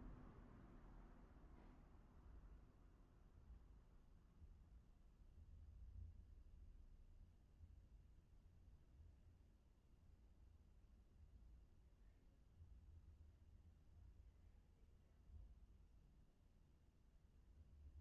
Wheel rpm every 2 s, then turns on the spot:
0, 0, 0, 0, 0, 0, 0, 0, 0.
none